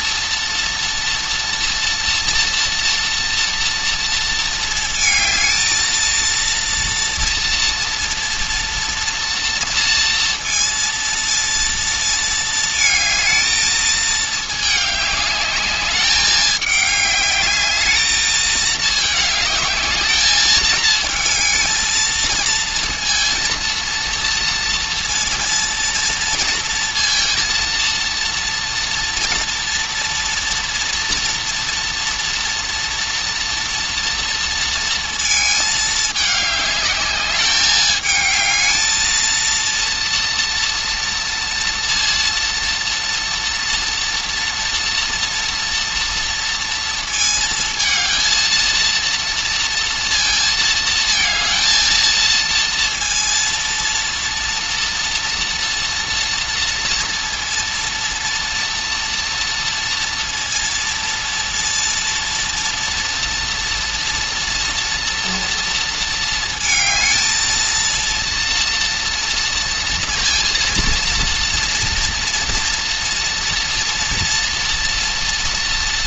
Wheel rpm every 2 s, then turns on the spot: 240, 230, 220, 230, 230, 230, 220, 210, 210, 220, 220, 230, 230, 230, 230, 230, 230, 230, 210, 220, 230, 230, 240, 230, 230, 220, 230, 230, 230, 230, 230, 230, 240, 220, 230, 230, 230, 230.
none